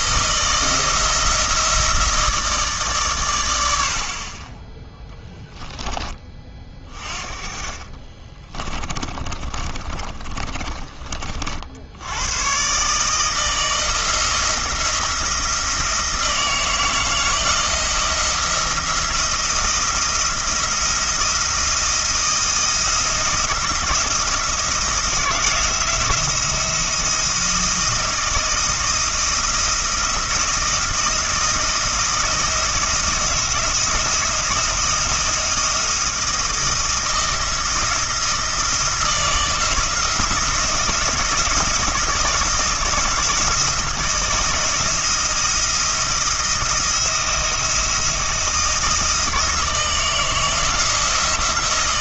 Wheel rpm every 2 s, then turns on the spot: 160, 150, 10, 30, 20, 30, 140, 170, 160, 170, 170, 170, 160, 170, 170, 160, 170, 170, 170, 160, 170, 170, 170, 160, 160, 160.
8-12